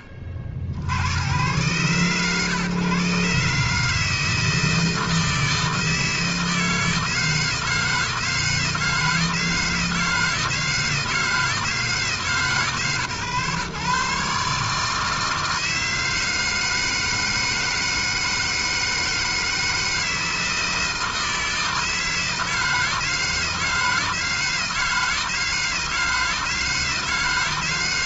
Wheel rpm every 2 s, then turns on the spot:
80, 130, 160, 160, 160, 160, 130, 150, 160, 160, 160, 160, 160, 160.
none